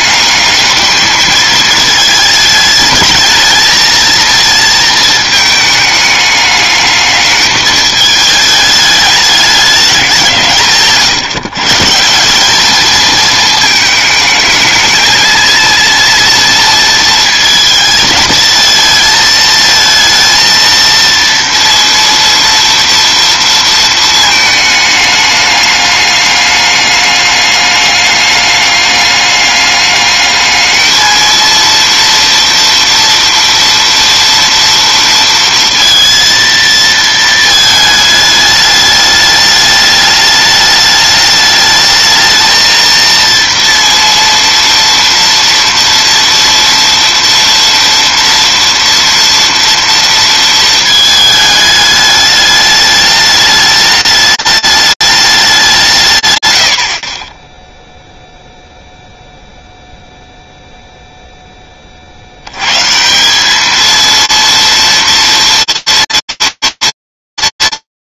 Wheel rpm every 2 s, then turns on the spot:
210, 210, 220, 210, 210, 140, 220, 220, 230, 220, 230, 230, 220, 210, 210, 220, 230, 230, 230, 210, 210, 220, 230, 230, 230, 230, 210, 210, 60, 0, 0, 200, 230, 230.
none